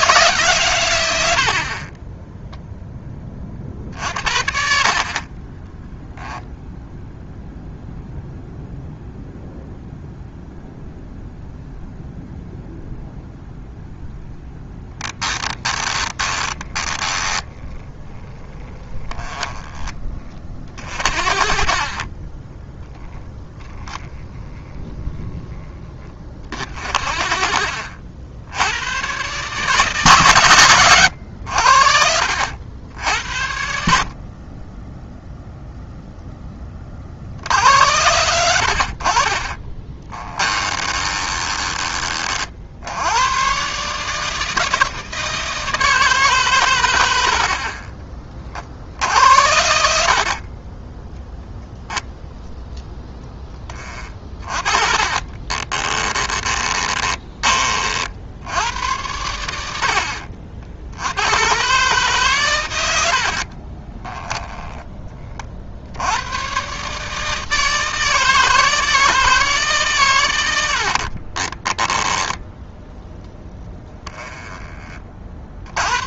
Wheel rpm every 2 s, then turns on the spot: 100, 10, 40, 0, 0, 0, 0, 10, 10, 10, 40, 10, 10, 40, 110, 100, 80, 10, 40, 50, 20, 80, 160, 100, 60, 10, 10, 30, 20, 90, 80, 90, 20, 140, 160, 60, 10, 30.
14-20 26-28 40-42 54-58 70-72